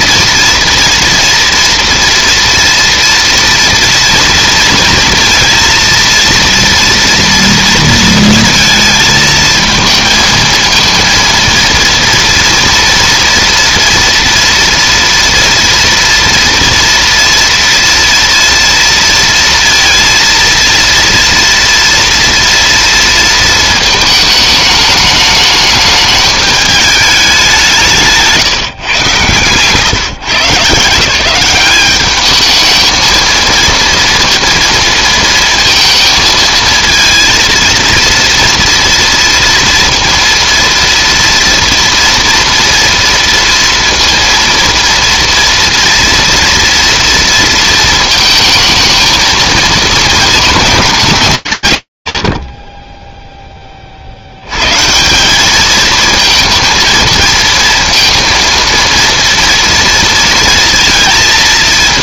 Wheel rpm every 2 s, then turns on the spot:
240, 230, 230, 230, 220, 230, 230, 240, 230, 230, 230, 230, 220, 210, 150, 150, 220, 230, 230, 230, 230, 230, 230, 230, 220, 220, 50, 90, 220, 230, 230.
28-30